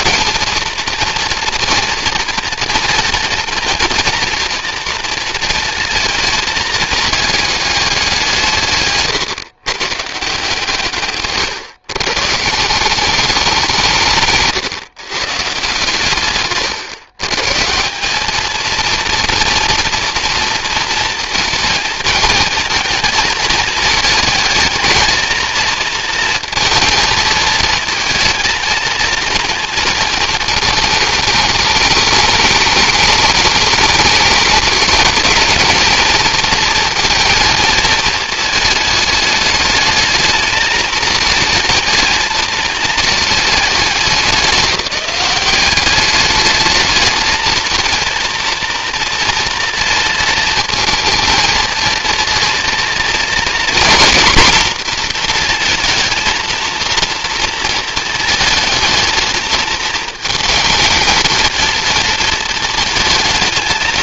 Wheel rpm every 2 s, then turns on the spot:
230, 230, 230, 220, 130, 140, 190, 130, 120, 230, 230, 220, 220, 230, 230, 220, 210, 220, 230, 220, 220, 220, 190, 220, 230, 230, 230, 240, 230, 220, 220, 220.
8-10